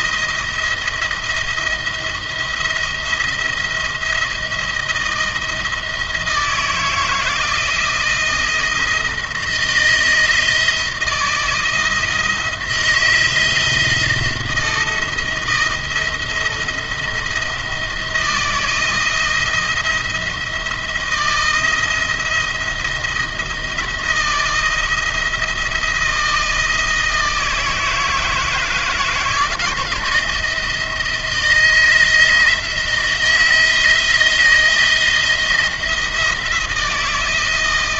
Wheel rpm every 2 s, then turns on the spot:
170, 170, 170, 160, 170, 160, 160, 170, 160, 160, 160, 170, 170, 160, 170, 170, 170, 170, 170.
none